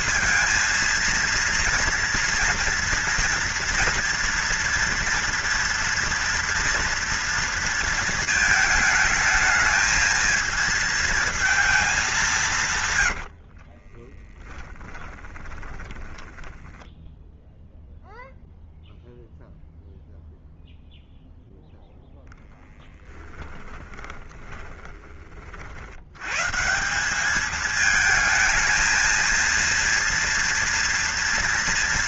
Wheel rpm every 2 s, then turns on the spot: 230, 240, 230, 230, 220, 220, 160, 20, 10, 0, 0, 10, 20, 140, 220, 230.
14-18 24-26